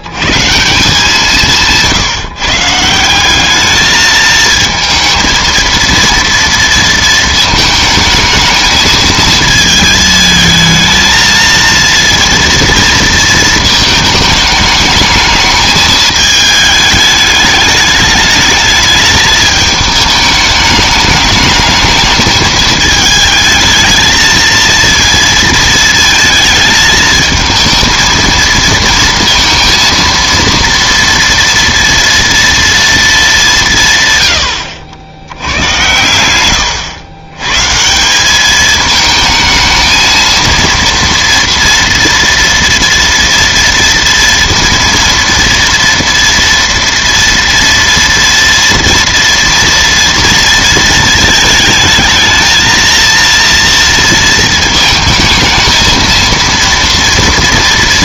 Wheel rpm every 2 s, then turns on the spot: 170, 160, 220, 230, 220, 220, 230, 210, 210, 210, 210, 210, 230, 220, 230, 230, 230, 70, 100, 210, 230, 230, 230, 230, 230, 230, 220, 230, 230.
34-36